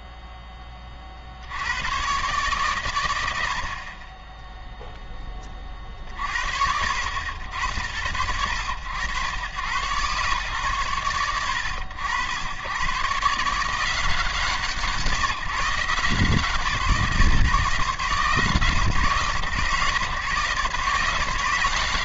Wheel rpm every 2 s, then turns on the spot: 20, 130, 0, 60, 90, 90, 120, 140, 150, 130, 140.
none